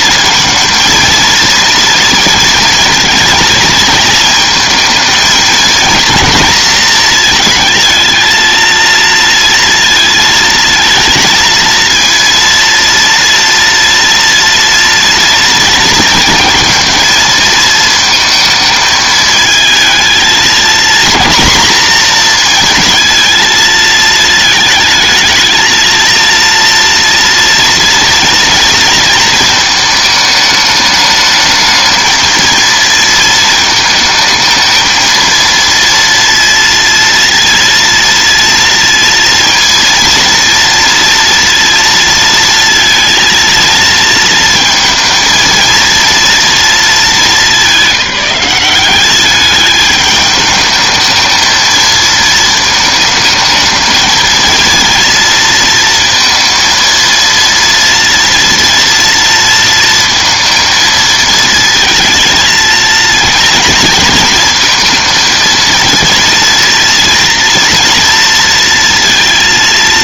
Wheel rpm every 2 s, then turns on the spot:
230, 230, 230, 230, 230, 230, 230, 230, 230, 220, 230, 230, 220, 230, 230, 210, 230, 220, 230, 230, 230, 230, 230, 210, 190, 220, 220, 230, 230, 230, 220, 230, 230, 230, 230.
none